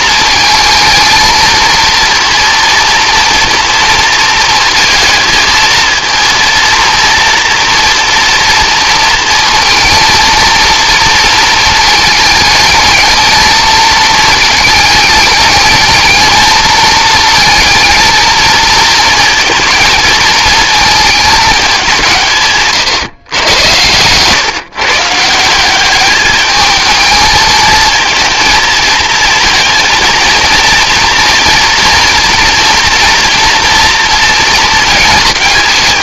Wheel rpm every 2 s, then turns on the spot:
230, 230, 220, 230, 230, 230, 220, 220, 220, 230, 220, 160, 140, 210, 230, 230, 230, 230.
none